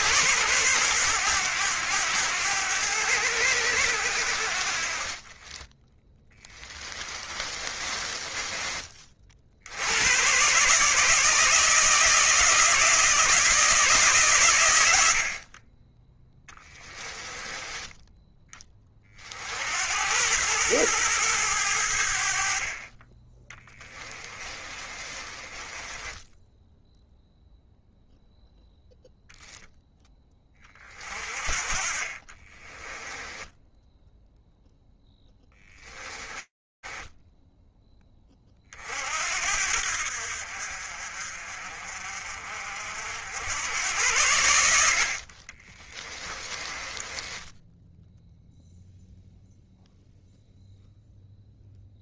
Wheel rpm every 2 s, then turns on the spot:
110, 90, 40, 20, 30, 150, 160, 100, 10, 30, 110, 30, 30, 0, 0, 30, 20, 0, 10, 60, 50, 80, 60, 10, 0, 0.
6-8 16-18 24-26 32-34 36-38 44-48